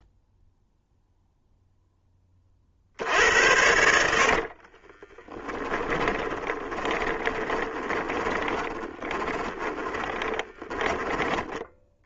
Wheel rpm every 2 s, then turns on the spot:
0, 40, 40, 20, 20, 10.
4-12